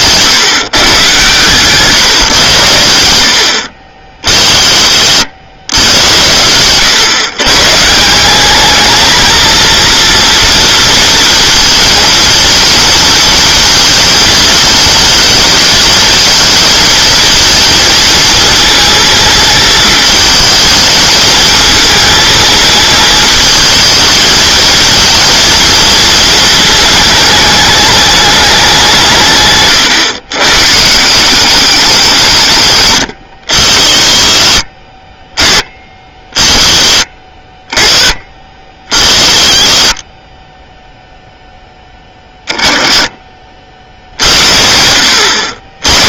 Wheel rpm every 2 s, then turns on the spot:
130, 100, 50, 110, 210, 230, 230, 220, 220, 230, 220, 220, 230, 220, 190, 140, 130, 40, 30, 40, 10, 20, 70.
36-38